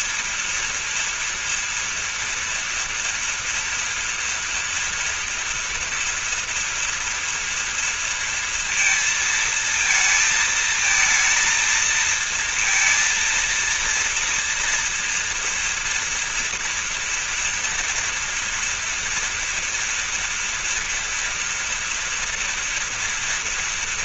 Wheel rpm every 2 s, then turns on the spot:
230, 230, 230, 230, 230, 220, 230, 230, 230, 240, 230, 230.
none